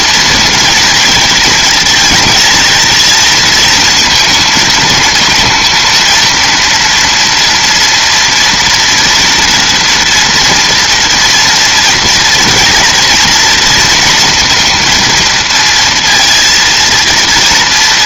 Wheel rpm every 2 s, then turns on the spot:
230, 230, 230, 230, 240, 230, 240, 230, 230.
none